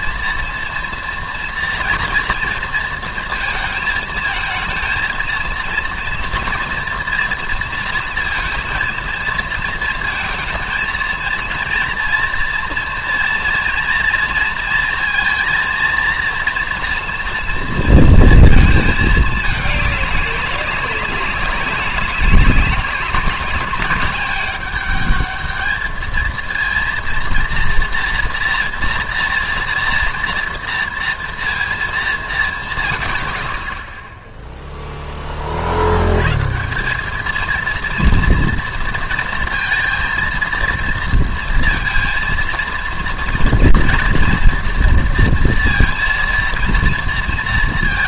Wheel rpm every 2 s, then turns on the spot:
230, 230, 220, 230, 230, 230, 230, 230, 230, 230, 200, 200, 210, 230, 230, 230, 180, 0, 150, 230, 230, 230, 230, 230.
none